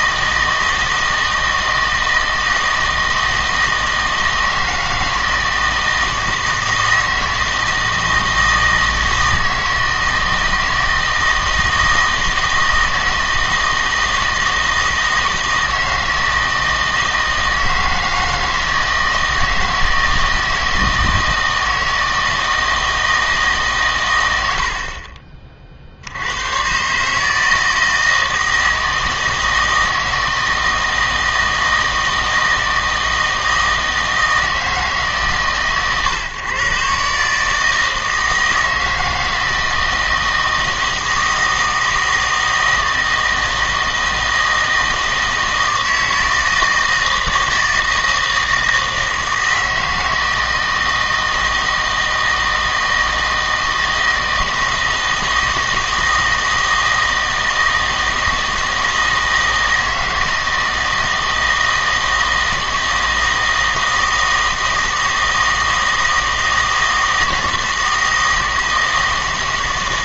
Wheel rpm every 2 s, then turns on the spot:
160, 160, 160, 160, 160, 160, 160, 160, 160, 160, 160, 160, 70, 120, 160, 160, 160, 160, 140, 160, 160, 160, 160, 160, 160, 160, 160, 160, 160, 160, 160, 160, 160, 160, 160.
none